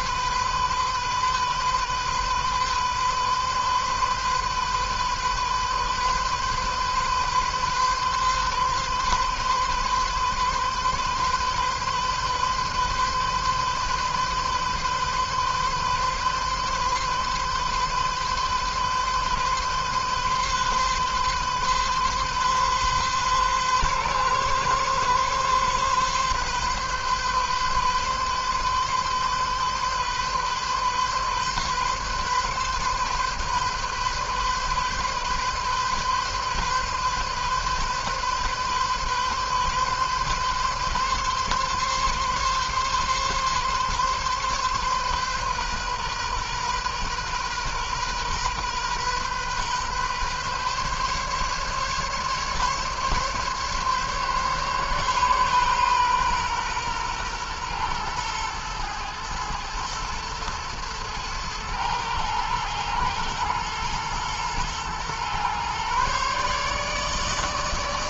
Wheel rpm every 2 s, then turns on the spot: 130, 130, 130, 130, 130, 130, 130, 130, 130, 130, 130, 130, 130, 130, 130, 130, 130, 130, 130, 130, 140, 140, 140, 130, 130, 130, 140, 140, 130, 110, 110, 110, 110, 140.
none